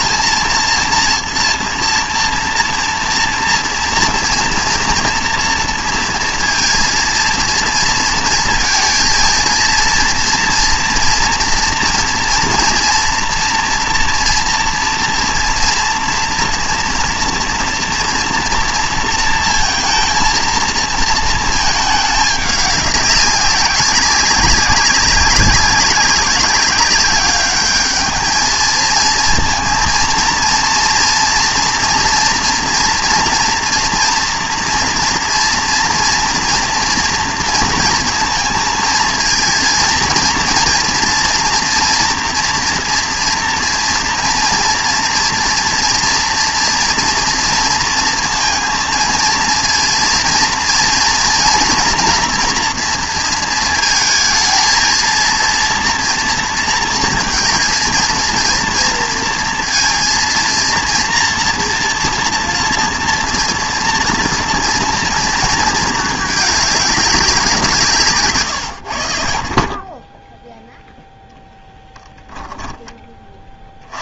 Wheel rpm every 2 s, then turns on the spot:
230, 230, 230, 230, 230, 230, 230, 230, 230, 230, 230, 200, 190, 200, 220, 230, 230, 230, 230, 220, 220, 240, 230, 230, 230, 230, 230, 230, 230, 230, 230, 230, 230, 210, 120, 0, 10.
none